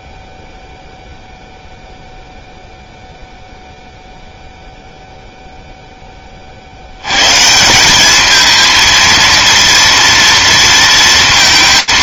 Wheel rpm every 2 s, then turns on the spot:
0, 0, 0, 70, 220, 230.
none